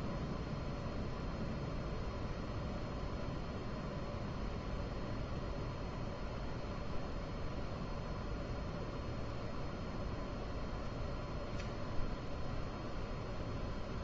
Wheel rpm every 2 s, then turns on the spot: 0, 0, 0, 0, 0, 0, 0.
none